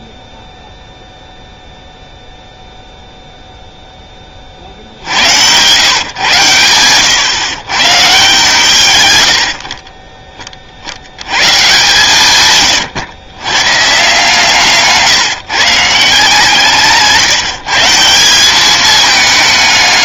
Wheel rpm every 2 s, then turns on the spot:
0, 0, 50, 110, 140, 40, 120, 160, 160, 200.
12-14